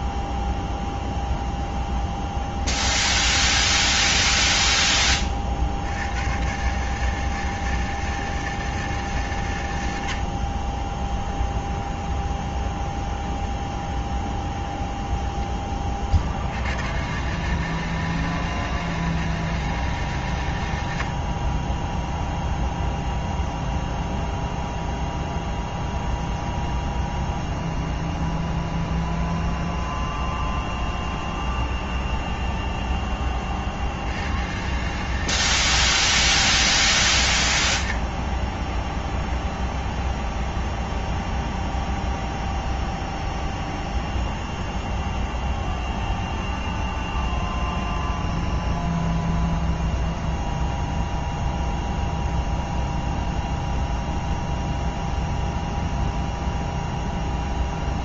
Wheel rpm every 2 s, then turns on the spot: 0, 10, 10, 130, 160, 50, 20, 20, 70, 160, 120, 0, 0, 0, 0, 0, 0, 100, 160, 30, 0, 0, 0, 0, 0, 0, 0, 0, 0.
2-4 12-16